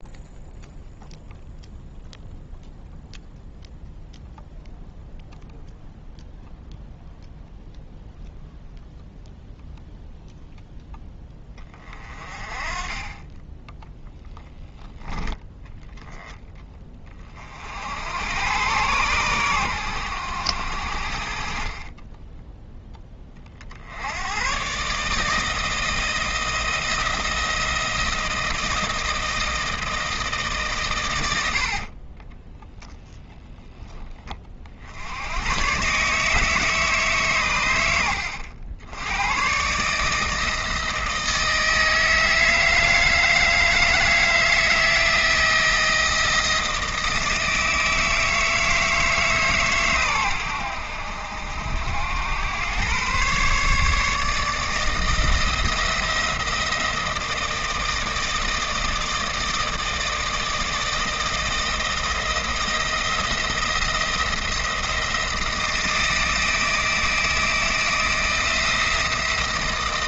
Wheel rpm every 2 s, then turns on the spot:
0, 0, 0, 0, 0, 0, 30, 0, 10, 110, 70, 0, 120, 170, 160, 140, 10, 50, 150, 80, 160, 160, 160, 160, 160, 90, 110, 160, 170, 160, 160, 170, 170, 160, 170.
32-34